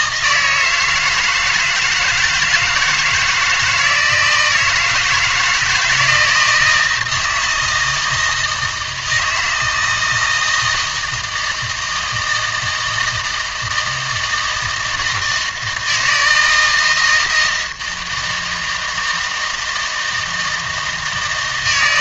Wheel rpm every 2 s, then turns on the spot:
160, 170, 160, 160, 160, 160, 160, 160, 160, 160, 160.
none